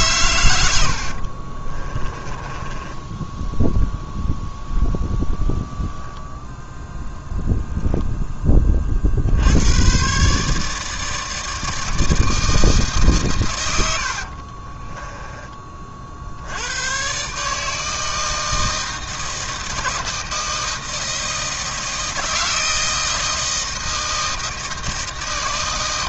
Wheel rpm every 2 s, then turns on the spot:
90, 20, 10, 0, 20, 150, 160, 40, 100, 160, 160, 160, 160.
0-4 14-16